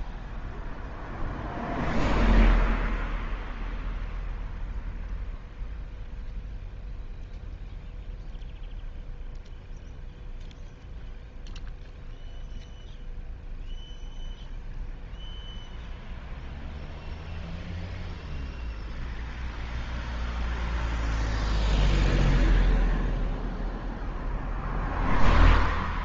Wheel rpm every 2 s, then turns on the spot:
0, 0, 0, 0, 0, 0, 0, 0, 0, 0, 0, 0, 0.
none